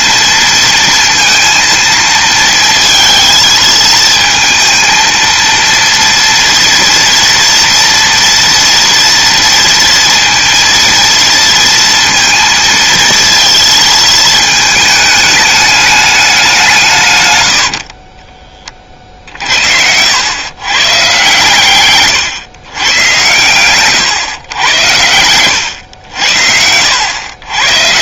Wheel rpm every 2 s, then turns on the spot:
230, 230, 230, 230, 230, 230, 230, 210, 110, 60, 140, 120, 90, 100.
none